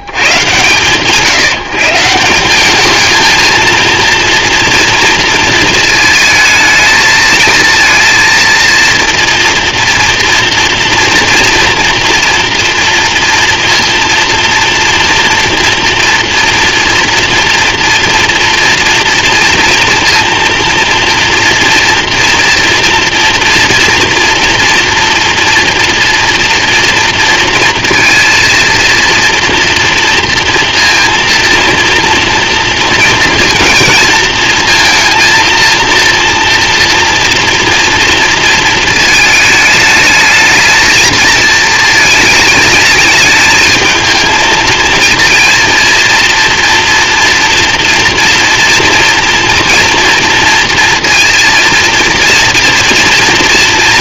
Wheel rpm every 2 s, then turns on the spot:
90, 180, 230, 220, 230, 230, 230, 240, 230, 230, 230, 230, 230, 230, 230, 230, 230, 230, 230, 230, 220, 220, 230, 230, 230, 230, 230.
none